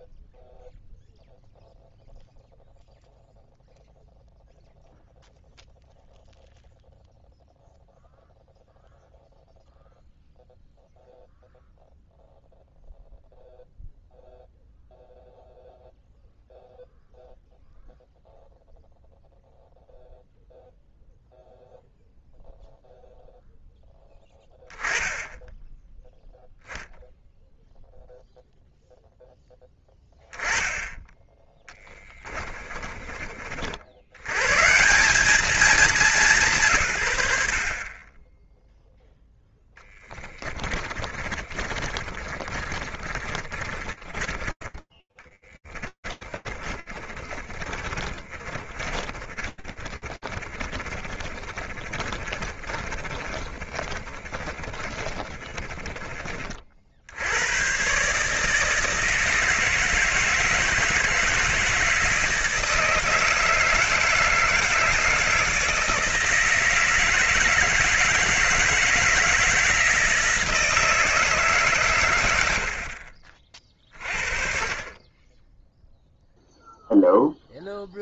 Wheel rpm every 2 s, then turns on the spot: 0, 0, 0, 0, 0, 0, 0, 0, 0, 0, 0, 0, 10, 0, 0, 10, 30, 160, 150, 0, 30, 30, 10, 30, 40, 30, 30, 20, 100, 160, 160, 160, 160, 160, 170, 150, 40, 10, 0.
32-34 40-44 46-56